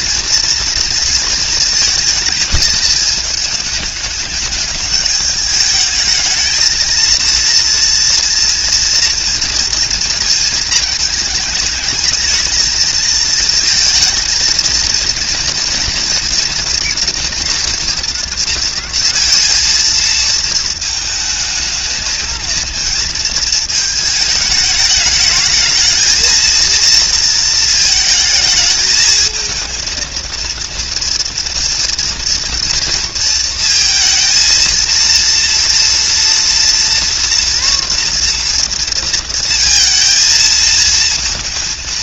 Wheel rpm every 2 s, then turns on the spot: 230, 230, 210, 220, 230, 230, 220, 230, 240, 230, 220, 230, 210, 220, 220, 230, 230, 230, 230, 230, 230.
none